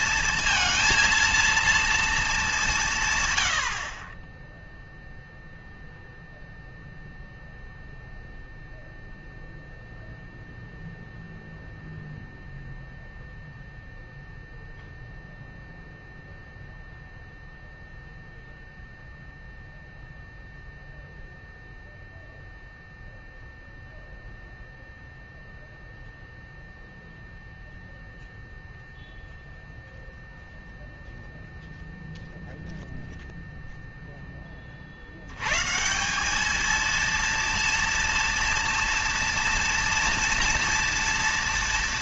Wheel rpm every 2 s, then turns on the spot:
230, 150, 0, 0, 0, 0, 0, 0, 0, 0, 0, 0, 0, 0, 0, 0, 0, 40, 220, 230, 230.
none